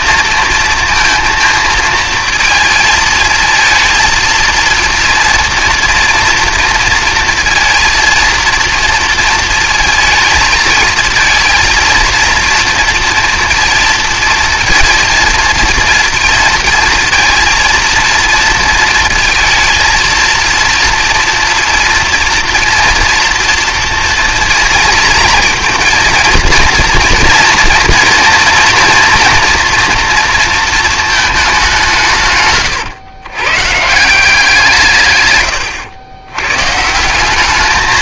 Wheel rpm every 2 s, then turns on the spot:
230, 220, 230, 230, 230, 220, 230, 230, 220, 230, 230, 230, 230, 230, 230, 220, 130, 160, 150.
none